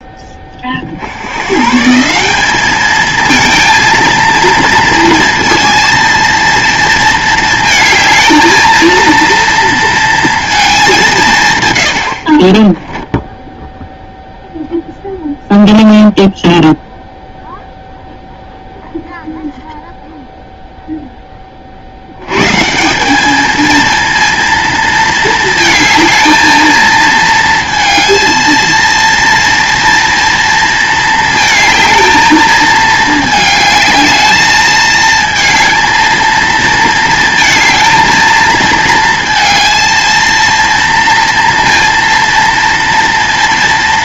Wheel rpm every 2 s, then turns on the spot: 50, 210, 230, 230, 230, 210, 20, 0, 0, 0, 0, 160, 230, 220, 230, 230, 220, 220, 220, 230, 230, 230.
12-14